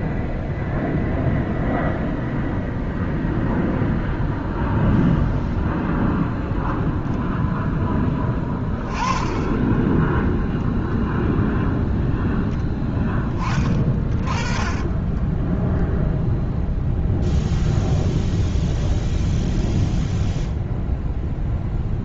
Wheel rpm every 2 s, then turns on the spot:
0, 0, 0, 0, 20, 0, 0, 20, 0, 0, 0.
14-16